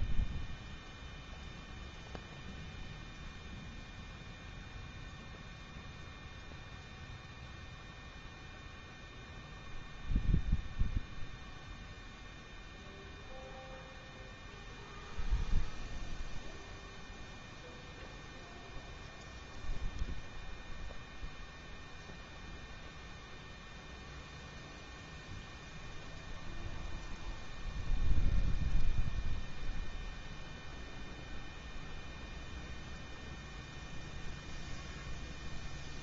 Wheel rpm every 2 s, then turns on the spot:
0, 0, 0, 0, 0, 0, 0, 0, 0, 0, 0, 0, 0, 0, 0, 0, 0, 0.
none